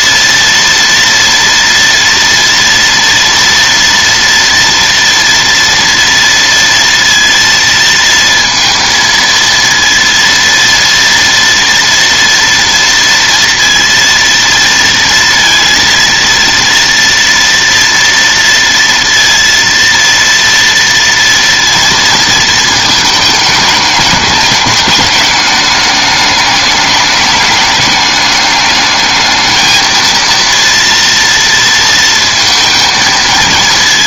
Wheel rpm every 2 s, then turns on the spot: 230, 230, 240, 230, 230, 230, 230, 230, 230, 230, 230, 220, 210, 210, 210, 230, 220.
none